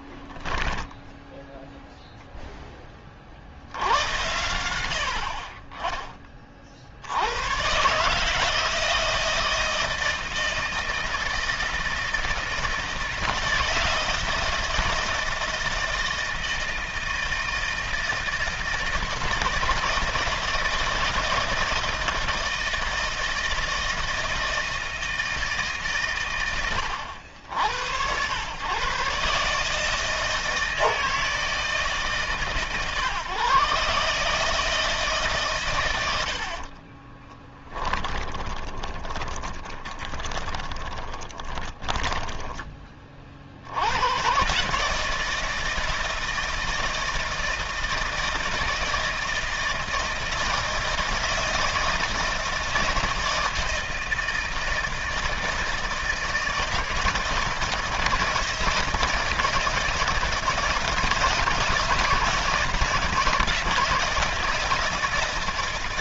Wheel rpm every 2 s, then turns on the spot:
10, 0, 90, 40, 150, 160, 160, 160, 160, 160, 160, 160, 160, 110, 100, 160, 140, 150, 70, 20, 20, 20, 130, 160, 160, 160, 160, 160, 160, 160, 160, 170, 160.
0-2 36-44